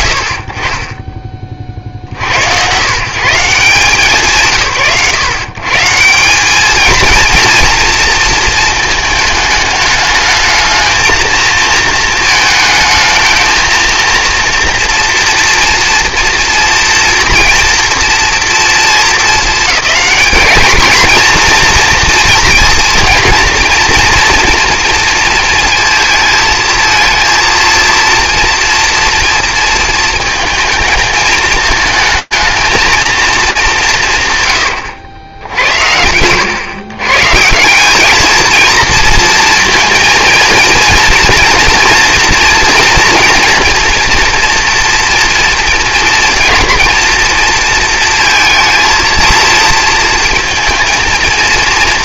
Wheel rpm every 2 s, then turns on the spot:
50, 110, 110, 220, 220, 220, 220, 230, 230, 220, 220, 230, 230, 230, 230, 220, 220, 120, 130, 230, 240, 240, 230, 230, 230, 230.
none